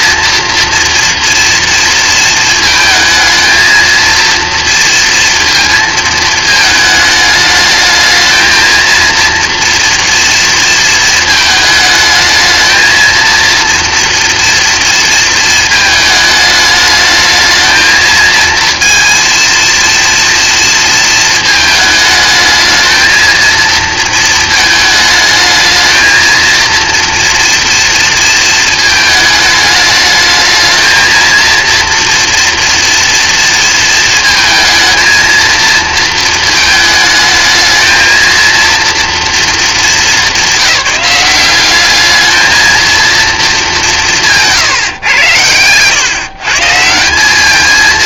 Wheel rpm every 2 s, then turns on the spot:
230, 220, 230, 220, 220, 220, 230, 230, 220, 230, 230, 220, 220, 230, 220, 220, 240, 230, 220, 230, 190, 230, 150, 160.
none